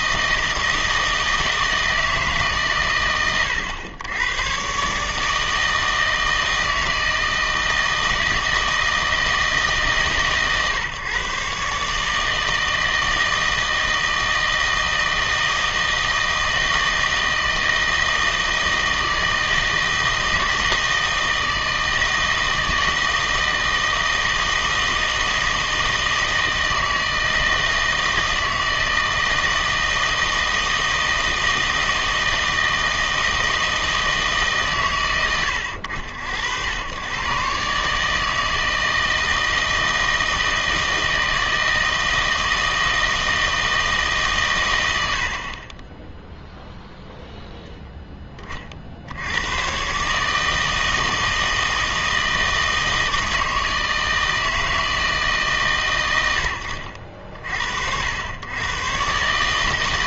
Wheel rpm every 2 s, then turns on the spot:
160, 140, 120, 160, 160, 130, 160, 160, 160, 160, 160, 160, 160, 160, 160, 160, 160, 140, 90, 160, 160, 160, 110, 0, 30, 160, 160, 160, 80, 120.
none